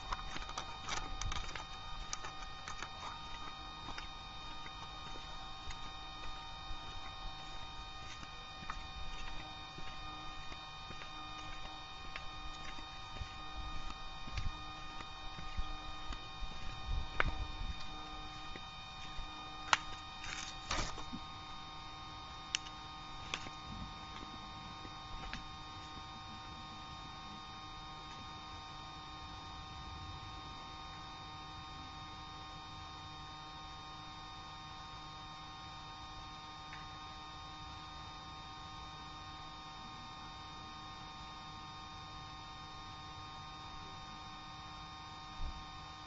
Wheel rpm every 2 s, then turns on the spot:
0, 0, 0, 0, 0, 0, 0, 0, 0, 0, 0, 0, 0, 0, 0, 0, 0, 0, 0, 0, 0, 0, 0.
none